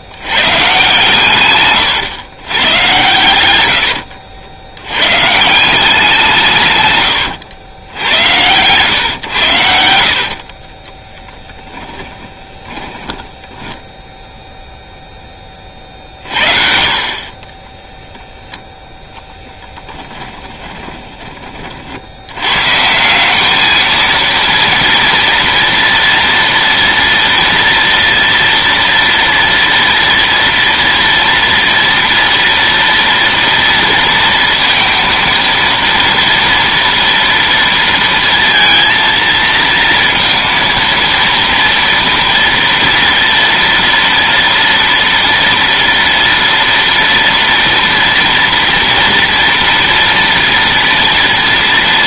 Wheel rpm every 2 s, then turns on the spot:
120, 110, 90, 140, 100, 50, 10, 0, 40, 0, 10, 120, 230, 230, 230, 230, 230, 230, 230, 230, 230, 230, 230, 230, 230, 230.
6-8 10-14 20-22